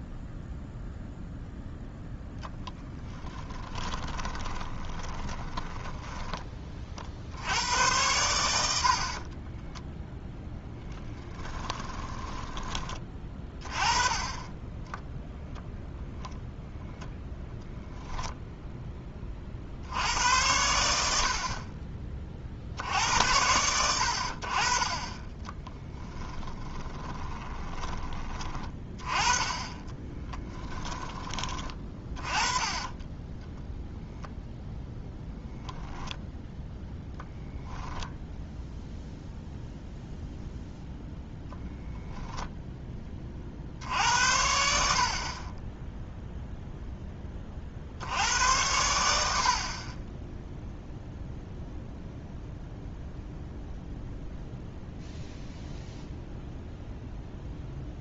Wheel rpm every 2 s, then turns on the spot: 0, 10, 20, 30, 70, 10, 20, 20, 0, 0, 90, 60, 40, 20, 20, 10, 30, 0, 0, 0, 0, 10, 70, 0, 90, 0, 0, 0, 0.
2-6 10-12 26-28 32-34